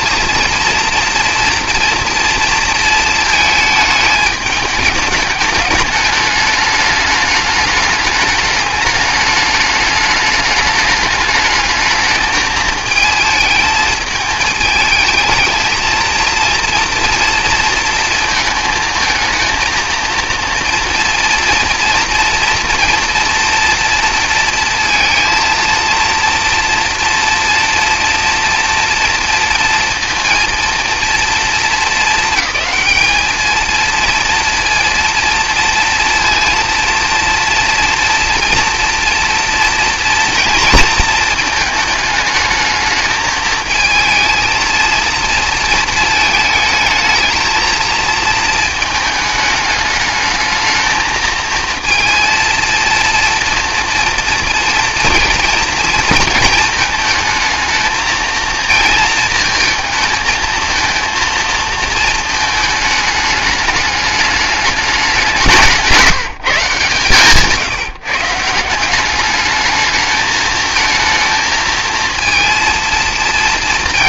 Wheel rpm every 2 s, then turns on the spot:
230, 220, 210, 210, 210, 210, 220, 220, 230, 230, 230, 230, 230, 230, 240, 230, 220, 230, 230, 230, 230, 220, 230, 220, 220, 220, 230, 230, 220, 230, 230, 220, 200, 150, 170, 220, 230.
none